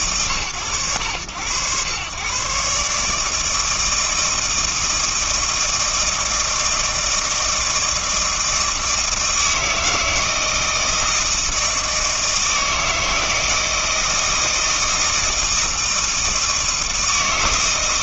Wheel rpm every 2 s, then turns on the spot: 110, 140, 160, 160, 160, 160, 160, 160, 160.
none